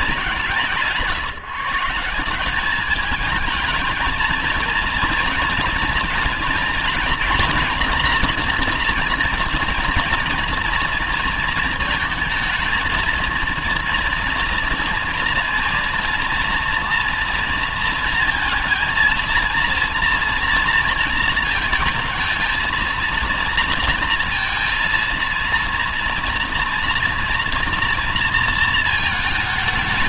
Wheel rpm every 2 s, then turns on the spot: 180, 180, 230, 240, 240, 230, 220, 230, 230, 230, 230, 220, 230, 240, 230.
none